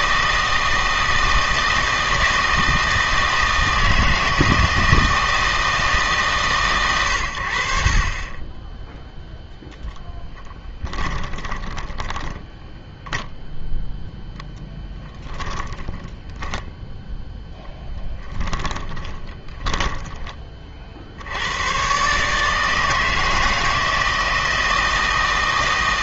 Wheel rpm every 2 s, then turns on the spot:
160, 160, 160, 120, 10, 10, 10, 0, 10, 20, 40, 160, 160.
10-12 18-20